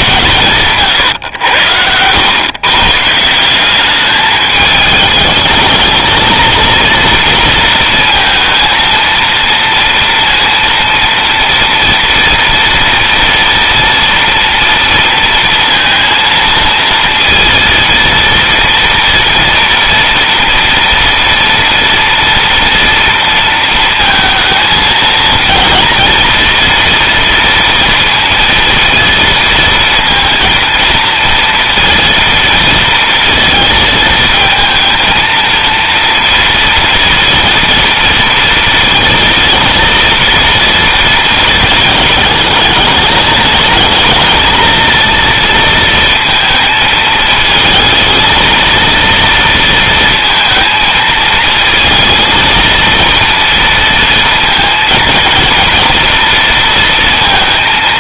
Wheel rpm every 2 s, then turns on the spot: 130, 130, 210, 230, 230, 230, 230, 230, 230, 230, 230, 230, 230, 230, 230, 230, 230, 220, 230, 230, 230, 210, 230, 220, 230, 220, 230, 230, 230.
none